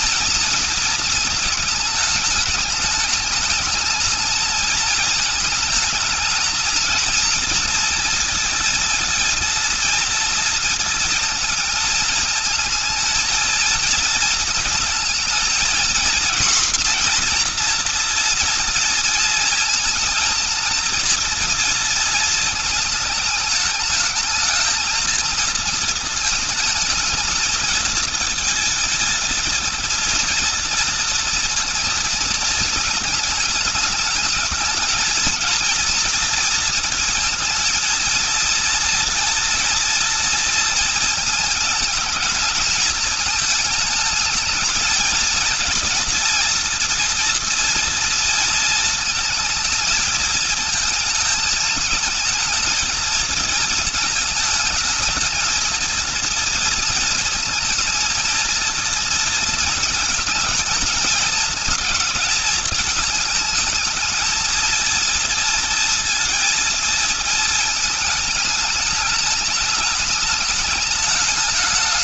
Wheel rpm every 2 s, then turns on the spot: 230, 210, 220, 220, 230, 230, 220, 220, 240, 230, 230, 220, 220, 220, 230, 230, 220, 220, 230, 230, 230, 220, 220, 230, 230, 220, 220, 220, 230, 220, 220, 220, 230, 230, 210, 210.
none